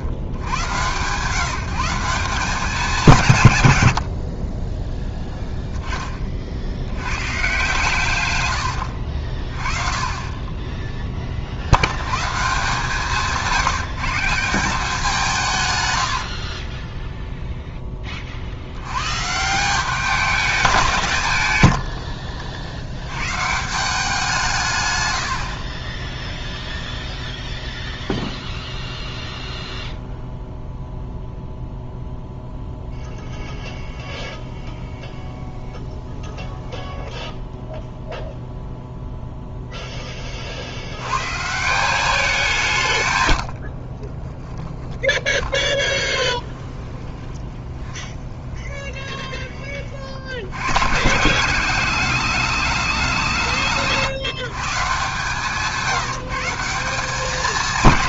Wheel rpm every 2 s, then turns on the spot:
90, 190, 30, 60, 100, 20, 150, 190, 40, 60, 200, 70, 150, 0, 0, 0, 0, 0, 0, 0, 40, 180, 10, 30, 20, 90, 200, 150, 180.
16-18 44-50